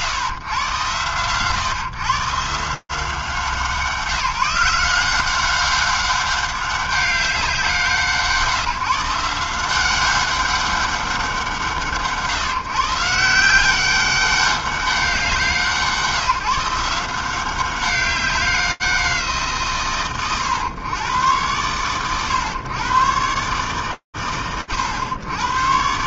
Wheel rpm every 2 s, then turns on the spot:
110, 150, 170, 200, 160, 200, 150, 190, 170, 190, 110, 110, 90.
none